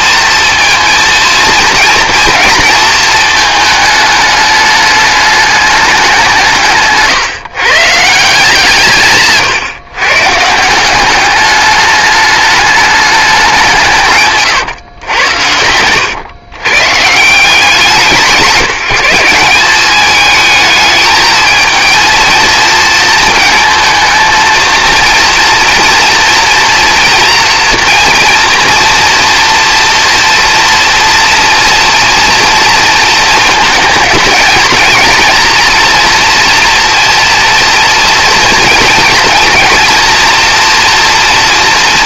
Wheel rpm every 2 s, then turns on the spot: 230, 230, 210, 150, 170, 160, 210, 140, 120, 180, 220, 230, 230, 240, 230, 240, 230, 220, 240, 230, 230.
none